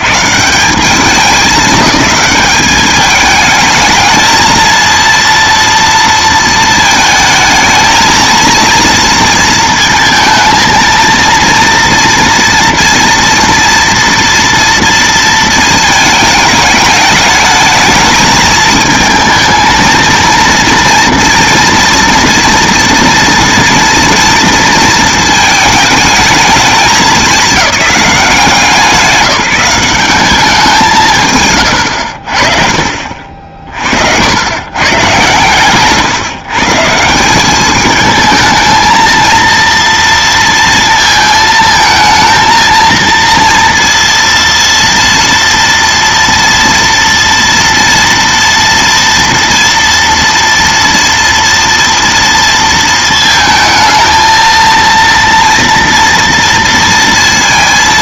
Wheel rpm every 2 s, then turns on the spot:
160, 210, 230, 230, 230, 230, 230, 230, 220, 220, 230, 230, 230, 210, 170, 180, 60, 130, 160, 220, 230, 230, 230, 230, 230, 230, 230, 230, 230.
none